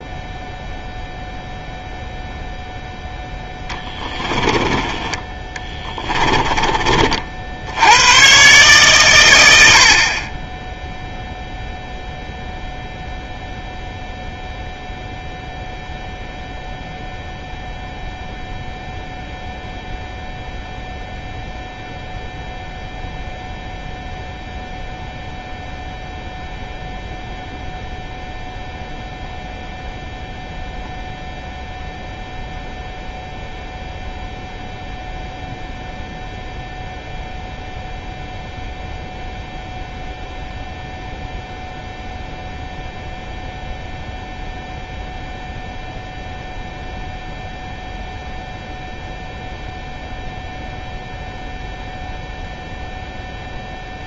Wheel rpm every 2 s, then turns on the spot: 0, 0, 20, 20, 130, 10, 0, 0, 0, 0, 0, 0, 0, 0, 0, 0, 0, 0, 0, 0, 0, 0, 0, 0, 0, 0, 0.
4-6